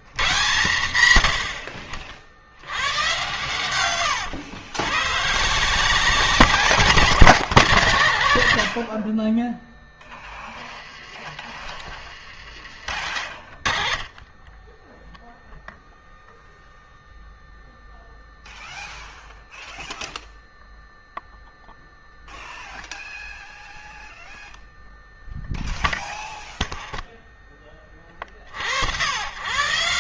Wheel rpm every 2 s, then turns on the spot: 120, 90, 100, 180, 50, 20, 50, 10, 0, 0, 0, 0, 0, 0, 80.
none